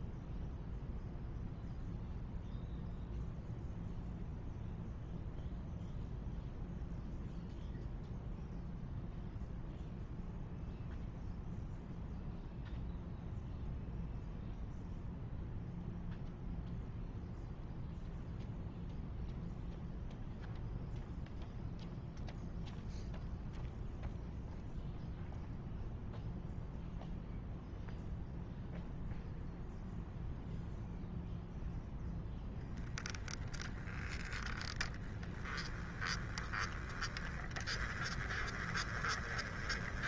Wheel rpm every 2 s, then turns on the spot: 0, 0, 0, 0, 0, 0, 0, 0, 0, 0, 0, 0, 0, 0, 0, 0, 0, 20, 10, 20.
none